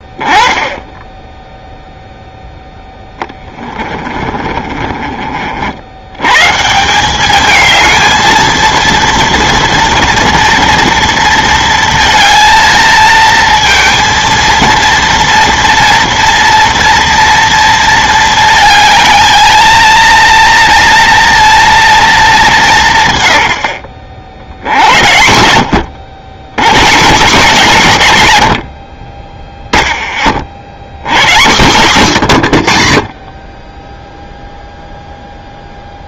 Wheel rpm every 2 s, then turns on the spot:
10, 0, 30, 170, 230, 230, 230, 230, 230, 220, 230, 180, 70, 120, 80, 70, 90, 0.
4-6